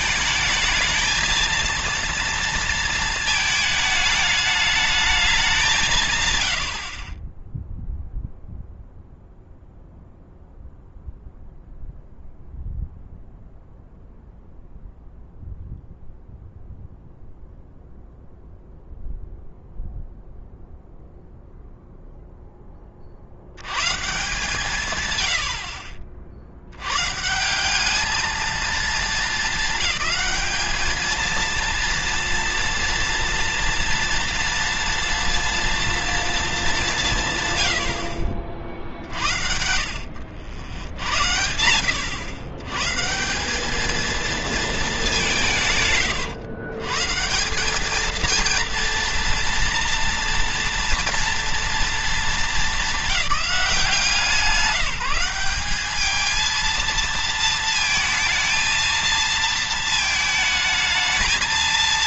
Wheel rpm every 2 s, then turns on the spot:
220, 230, 210, 70, 0, 0, 0, 0, 0, 0, 0, 10, 130, 100, 220, 220, 230, 230, 190, 50, 80, 130, 200, 130, 230, 230, 210, 180, 230, 230, 220.
none